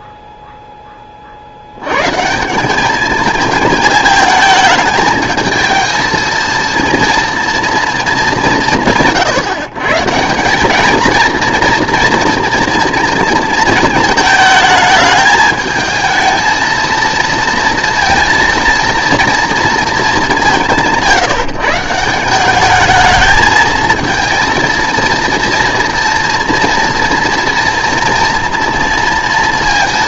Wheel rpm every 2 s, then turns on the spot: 10, 190, 220, 230, 170, 200, 230, 220, 230, 230, 190, 200, 230, 240, 230.
none